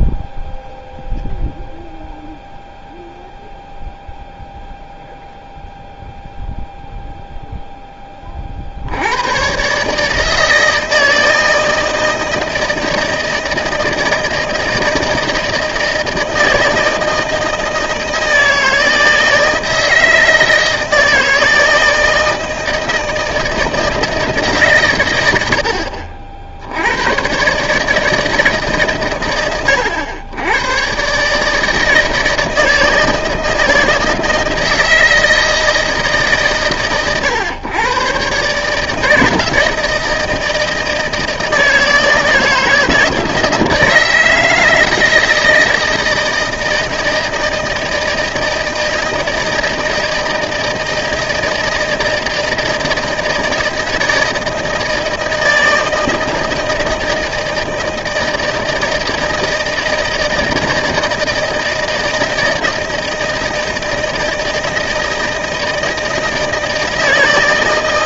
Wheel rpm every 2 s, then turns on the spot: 0, 0, 0, 0, 60, 160, 160, 160, 160, 160, 160, 160, 150, 70, 140, 110, 160, 160, 130, 150, 160, 160, 160, 160, 160, 160, 160, 160, 160, 160, 160, 160, 160, 160.
none